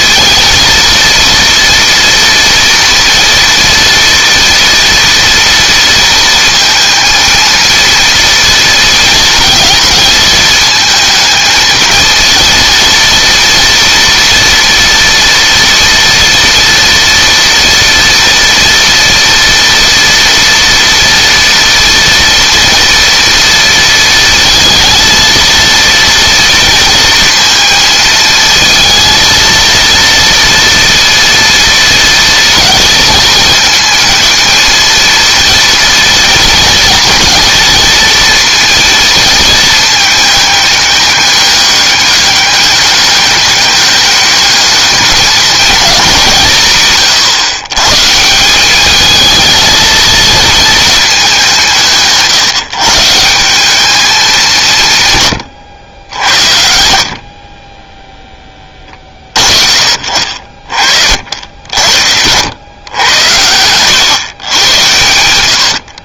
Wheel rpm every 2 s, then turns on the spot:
230, 230, 230, 230, 230, 220, 230, 230, 230, 230, 230, 240, 230, 230, 230, 230, 230, 220, 230, 230, 210, 200, 210, 130, 200, 220, 140, 150, 50, 20, 40, 90, 100.
none